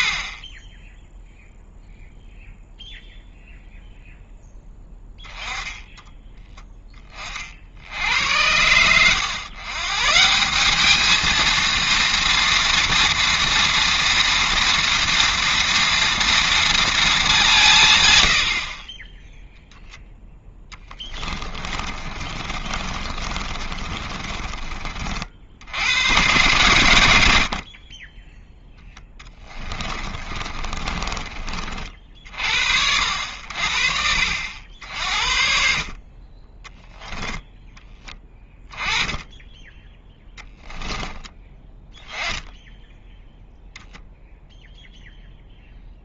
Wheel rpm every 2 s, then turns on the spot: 10, 0, 10, 10, 90, 190, 230, 230, 230, 60, 10, 30, 30, 120, 10, 30, 60, 60, 20, 10, 10, 10, 0.
20-24 30-32